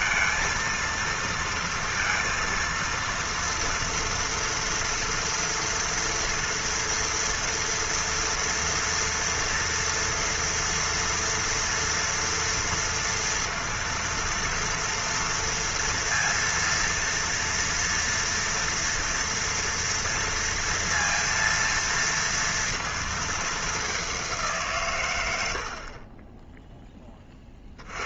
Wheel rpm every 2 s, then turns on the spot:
230, 230, 230, 230, 240, 230, 230, 230, 230, 230, 230, 230, 150, 10.
none